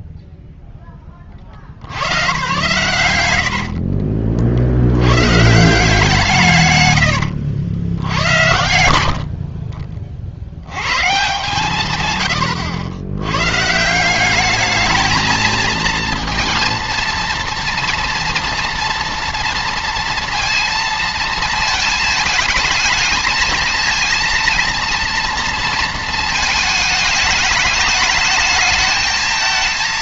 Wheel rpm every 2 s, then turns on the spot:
0, 100, 50, 130, 100, 90, 110, 210, 230, 230, 230, 220, 230, 220, 220.
8-10